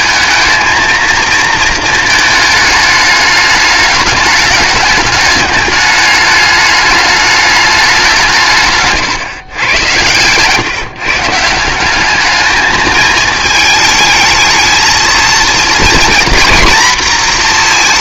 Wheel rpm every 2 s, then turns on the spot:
220, 220, 210, 210, 150, 140, 210, 220, 230.
none